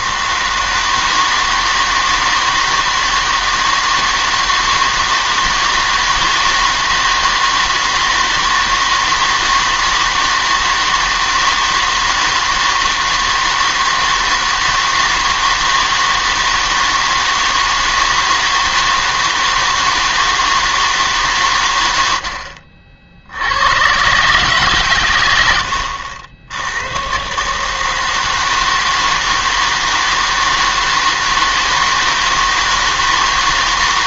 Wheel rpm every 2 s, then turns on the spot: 160, 160, 160, 160, 160, 160, 160, 160, 160, 160, 160, 60, 140, 80, 160, 160, 160.
22-24